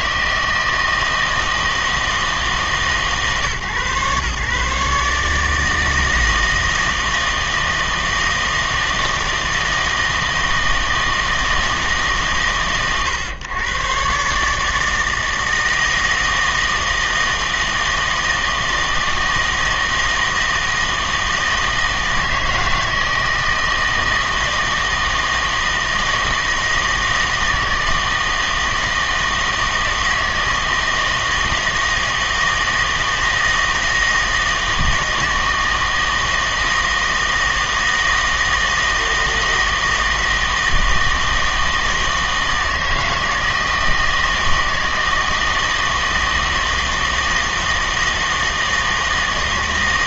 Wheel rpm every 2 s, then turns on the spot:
160, 150, 140, 160, 160, 160, 120, 150, 160, 160, 160, 160, 160, 160, 160, 160, 160, 160, 160, 160, 160, 160, 160, 160, 160.
none